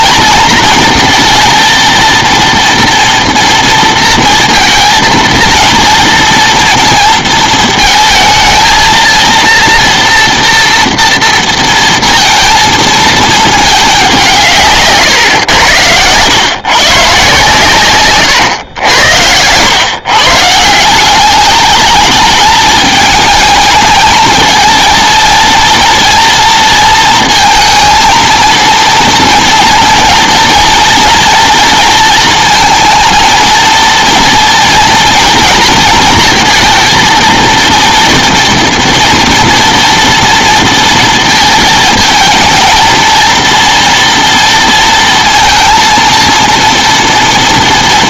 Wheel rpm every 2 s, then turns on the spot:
230, 230, 230, 230, 220, 230, 230, 160, 120, 100, 160, 210, 230, 230, 230, 230, 220, 230, 220, 230, 230, 220, 230, 230.
none